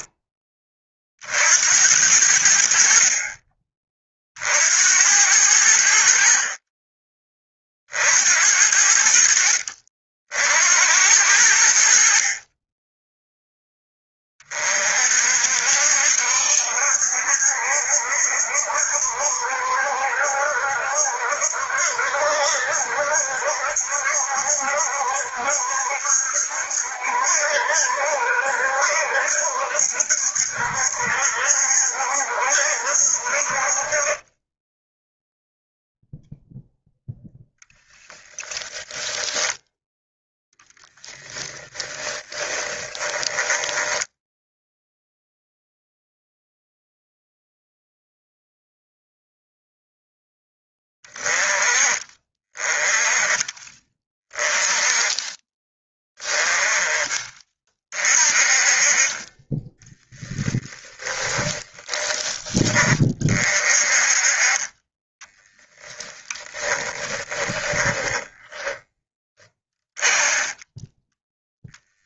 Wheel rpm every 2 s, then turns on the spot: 40, 50, 80, 20, 70, 80, 10, 50, 70, 70, 70, 70, 70, 70, 70, 70, 60, 10, 10, 20, 10, 20, 0, 0, 0, 20, 20, 20, 20, 30, 10, 30, 20, 10, 10, 10.
38-40 42-44 60-62 66-72